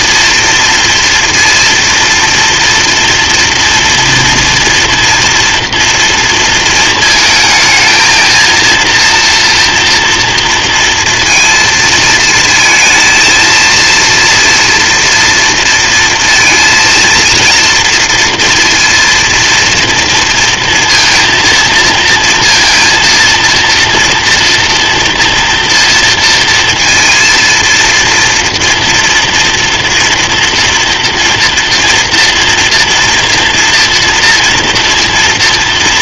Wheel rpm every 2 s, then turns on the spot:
230, 230, 240, 230, 230, 230, 230, 230, 230, 230, 230, 230, 230, 230, 230, 230, 230, 230.
none